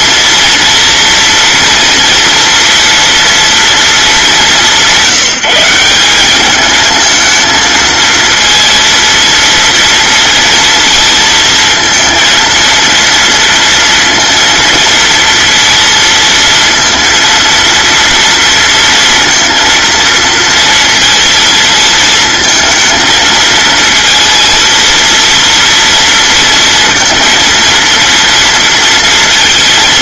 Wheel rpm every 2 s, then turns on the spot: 230, 230, 180, 220, 230, 230, 230, 230, 230, 230, 230, 230, 230, 230, 230.
none